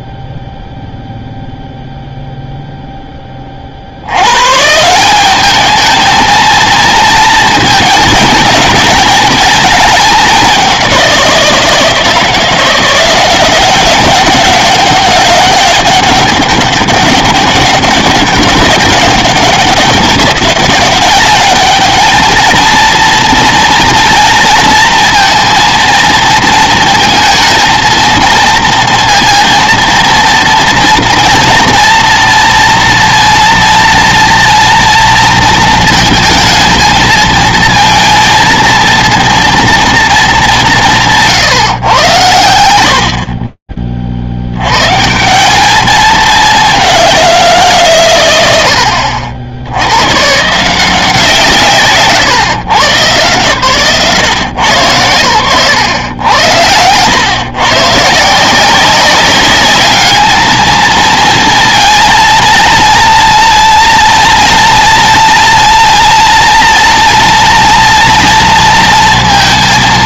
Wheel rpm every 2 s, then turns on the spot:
0, 0, 80, 220, 220, 210, 160, 190, 200, 200, 200, 220, 230, 230, 230, 230, 230, 230, 230, 230, 220, 120, 70, 210, 90, 150, 140, 130, 90, 170, 220, 230, 240, 230, 230.
54-56